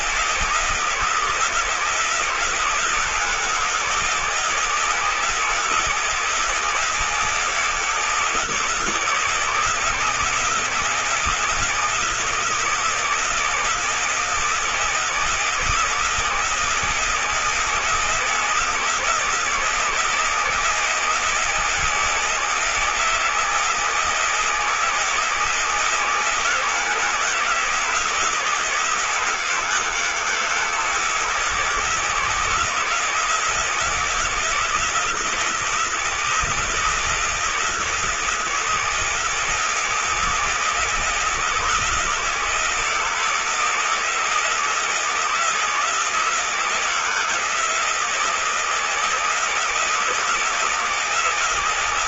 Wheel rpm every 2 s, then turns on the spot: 160, 170, 160, 160, 170, 160, 160, 160, 160, 170, 160, 160, 160, 160, 170, 160, 170, 170, 160, 170, 160, 160, 160, 170, 160, 160.
none